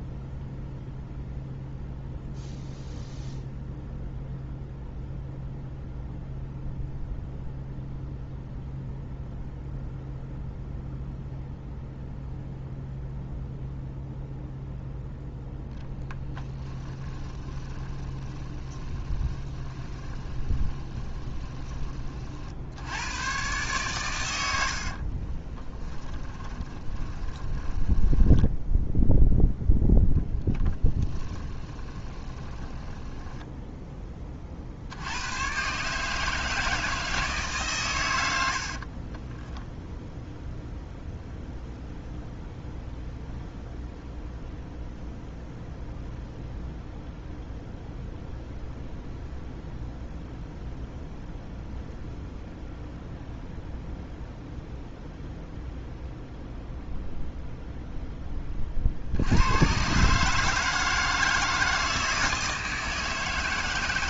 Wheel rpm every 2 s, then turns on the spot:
0, 0, 0, 0, 0, 0, 0, 0, 20, 20, 20, 70, 60, 20, 0, 10, 10, 70, 160, 40, 0, 0, 0, 0, 0, 0, 0, 0, 0, 60, 160, 160.
16-22 24-28 30-34 38-40